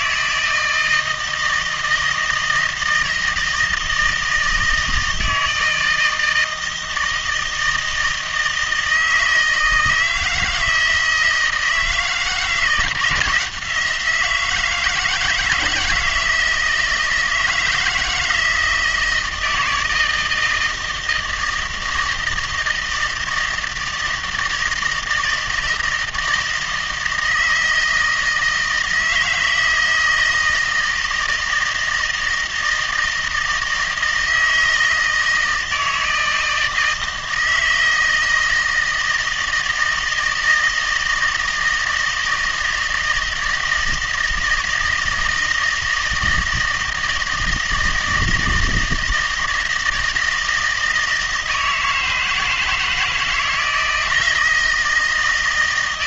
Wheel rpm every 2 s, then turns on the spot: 160, 160, 160, 160, 160, 160, 170, 160, 170, 160, 160, 160, 160, 160, 160, 160, 160, 160, 160, 160, 160, 160, 160, 160, 160, 160, 160, 160.
none